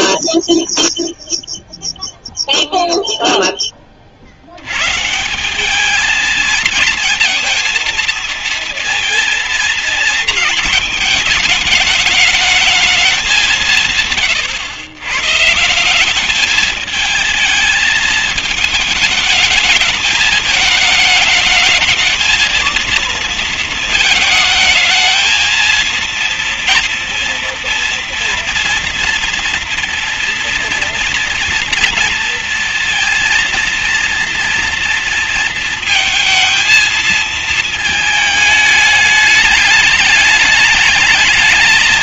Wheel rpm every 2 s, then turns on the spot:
0, 0, 90, 220, 230, 220, 210, 100, 210, 220, 220, 220, 220, 230, 230, 230, 230, 230, 230, 220, 210.
none